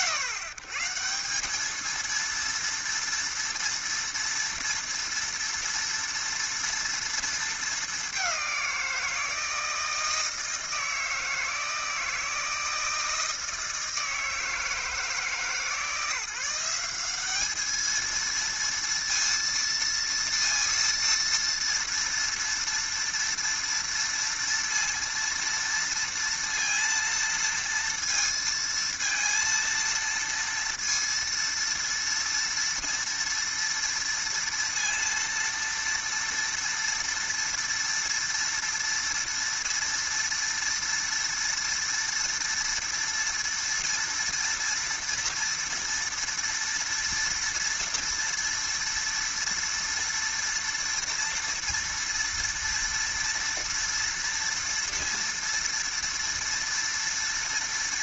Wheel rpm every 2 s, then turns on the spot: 130, 230, 230, 230, 180, 160, 160, 160, 180, 230, 230, 230, 230, 230, 230, 230, 230, 230, 230, 230, 230, 230, 230, 230, 230, 230, 230, 230, 230.
none